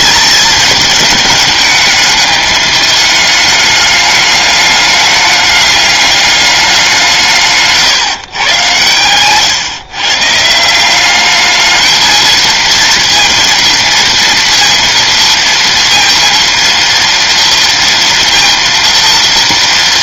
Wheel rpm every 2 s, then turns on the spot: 220, 210, 210, 200, 120, 160, 230, 230, 230, 230.
none